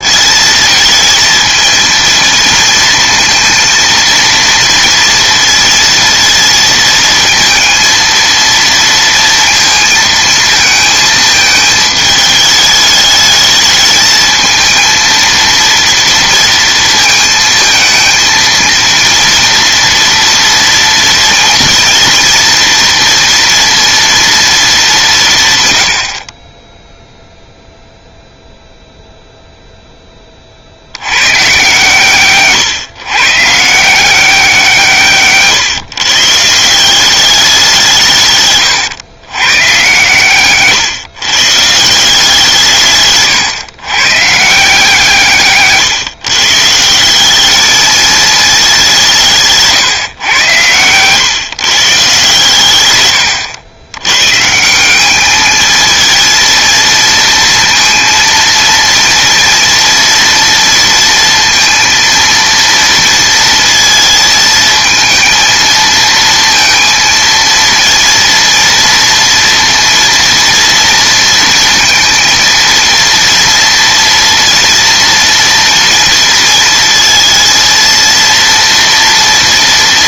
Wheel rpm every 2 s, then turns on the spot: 220, 230, 230, 230, 230, 220, 210, 230, 220, 230, 230, 230, 210, 10, 0, 50, 130, 150, 180, 120, 140, 140, 150, 170, 190, 130, 120, 170, 230, 230, 230, 230, 220, 230, 230, 230, 230, 230, 230, 230.
52-54